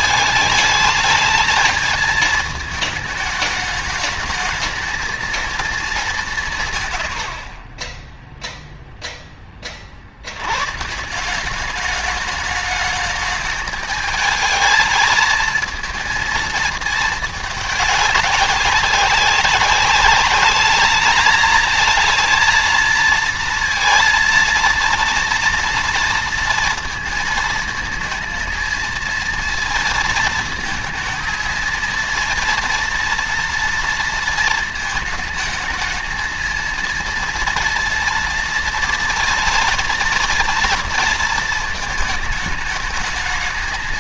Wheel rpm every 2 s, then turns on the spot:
210, 210, 220, 120, 0, 150, 210, 220, 220, 200, 210, 230, 230, 230, 230, 230, 230, 220, 230, 230, 230, 220.
none